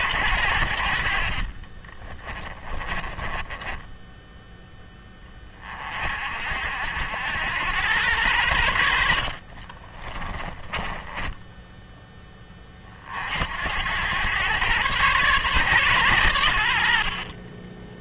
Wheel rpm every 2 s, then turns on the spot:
70, 20, 10, 70, 80, 10, 30, 120, 70.
2-4 10-12